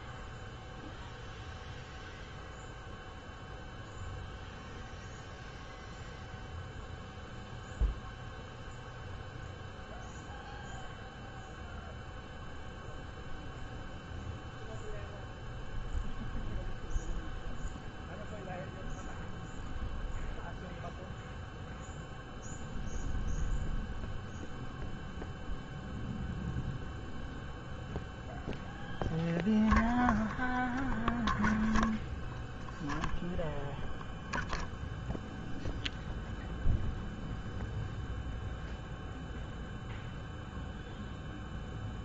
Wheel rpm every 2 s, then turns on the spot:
0, 0, 0, 0, 0, 0, 0, 0, 0, 0, 0, 0, 0, 0, 0, 0, 0, 0, 0, 0, 0.
none